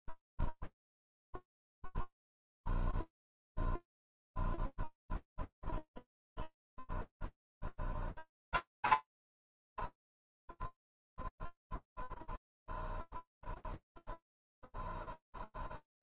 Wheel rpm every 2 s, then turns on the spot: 0, 0, 0, 0, 50, 10, 0, 0.
none